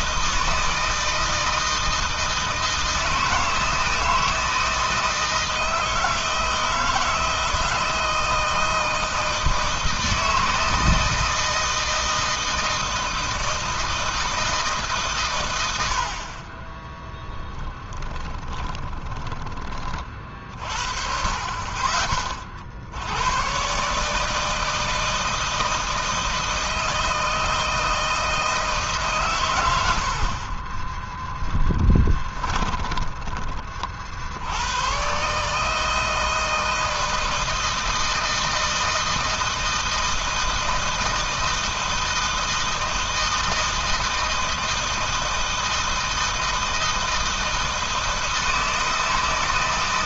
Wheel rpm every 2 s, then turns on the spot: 160, 160, 160, 160, 160, 160, 160, 160, 40, 20, 50, 50, 160, 160, 160, 50, 20, 90, 160, 160, 160, 160, 160, 160, 160.
18-20 32-34